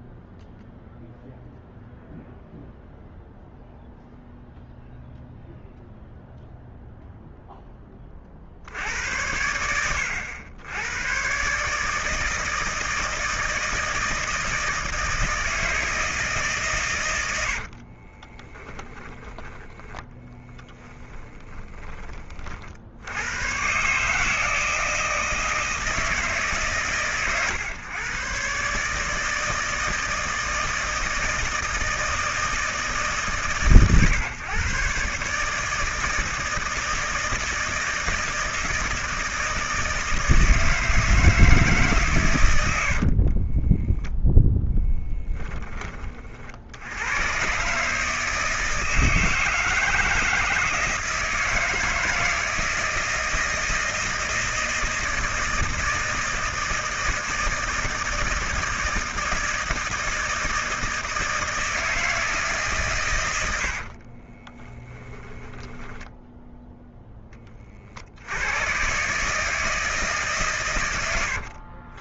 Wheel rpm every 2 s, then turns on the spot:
0, 0, 0, 0, 60, 90, 160, 160, 150, 30, 10, 50, 160, 140, 130, 160, 160, 120, 160, 160, 160, 110, 10, 60, 160, 160, 160, 160, 160, 160, 160, 150, 20, 10, 100, 130.
18-22 44-46 64-66